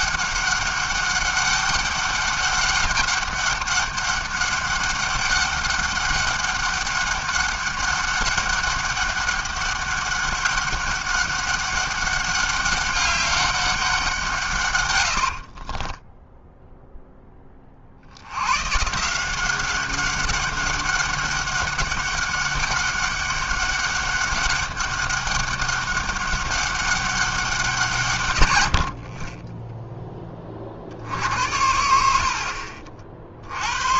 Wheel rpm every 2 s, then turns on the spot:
190, 200, 200, 200, 200, 200, 200, 140, 0, 120, 200, 200, 200, 200, 90, 30, 50.
none